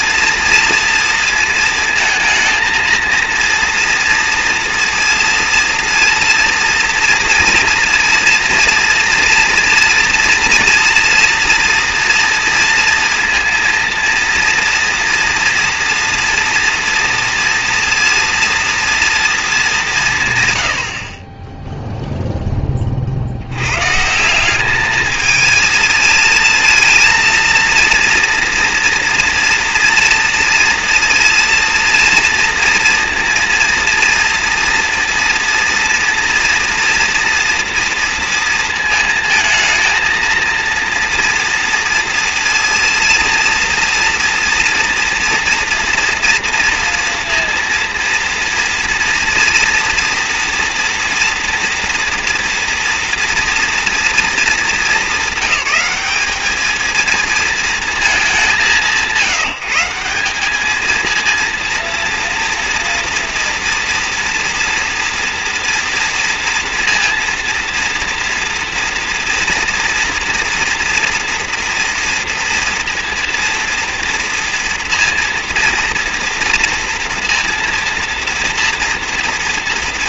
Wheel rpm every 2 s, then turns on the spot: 230, 230, 230, 230, 230, 240, 230, 230, 230, 230, 120, 10, 200, 230, 230, 230, 230, 230, 230, 230, 230, 230, 240, 230, 230, 240, 230, 210, 210, 190, 200, 230, 230, 230, 230, 230, 230, 230, 230, 230.
none